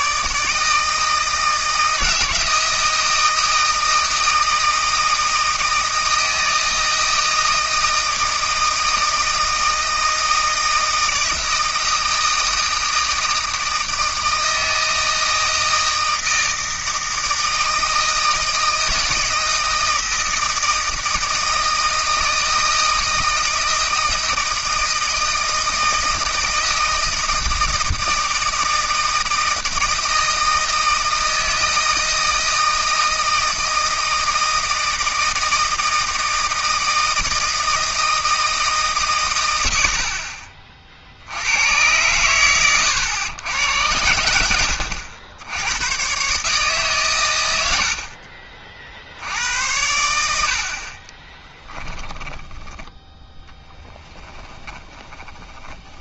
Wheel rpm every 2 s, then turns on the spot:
160, 160, 160, 160, 160, 160, 160, 160, 160, 160, 160, 160, 160, 160, 160, 160, 160, 160, 160, 160, 40, 110, 80, 140, 40, 60, 10, 10.
52-56